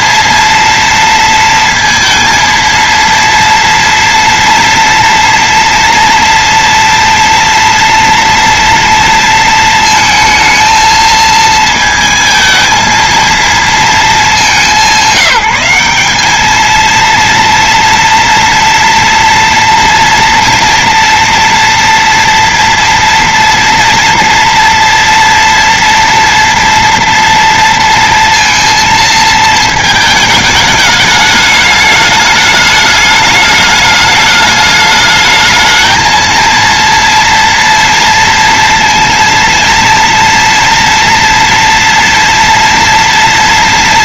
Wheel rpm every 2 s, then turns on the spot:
230, 230, 230, 230, 230, 220, 230, 180, 230, 230, 230, 230, 230, 230, 230, 210, 210, 210, 230, 230, 230, 230.
none